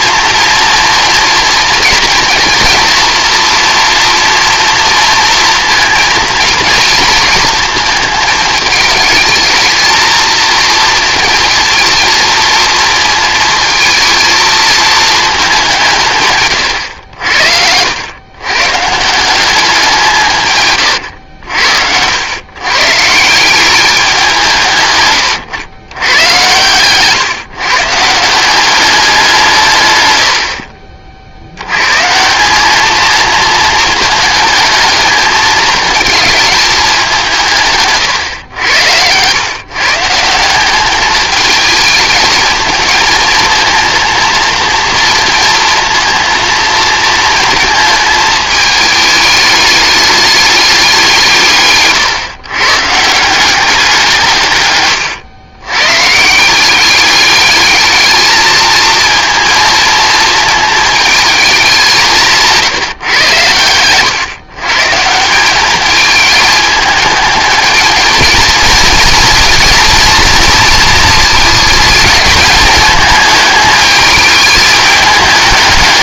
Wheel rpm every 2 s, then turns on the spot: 230, 230, 230, 230, 220, 230, 230, 220, 110, 150, 120, 150, 140, 130, 190, 50, 210, 220, 210, 90, 200, 220, 230, 230, 210, 190, 150, 110, 180, 230, 220, 150, 140, 210, 230, 230, 220, 210.
54-56